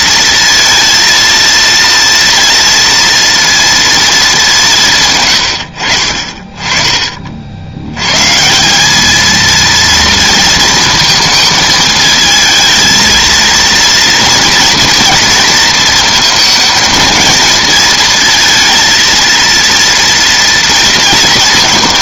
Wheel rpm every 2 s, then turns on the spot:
230, 230, 170, 30, 180, 230, 220, 230, 230, 230, 230.
none